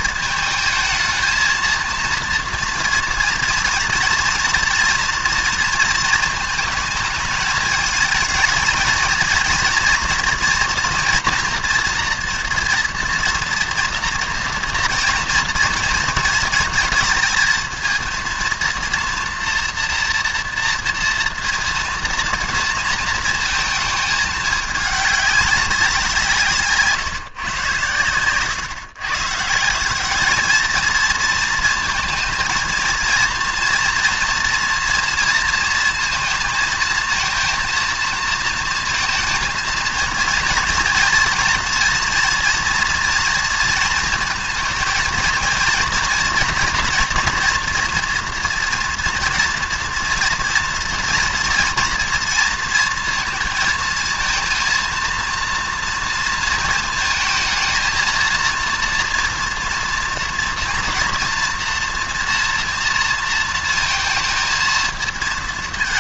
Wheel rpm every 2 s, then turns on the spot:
220, 230, 230, 220, 220, 230, 230, 230, 220, 230, 240, 230, 210, 150, 120, 220, 230, 230, 220, 220, 230, 230, 220, 230, 230, 230, 230, 230, 230, 230, 230, 230, 230.
none